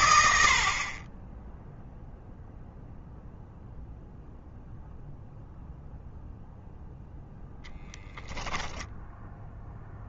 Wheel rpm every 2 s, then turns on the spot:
30, 0, 0, 0, 0.
none